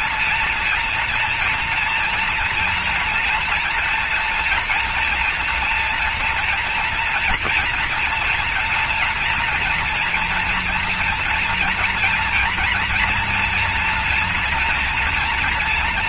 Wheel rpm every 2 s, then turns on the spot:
230, 230, 230, 230, 230, 230, 240, 230.
none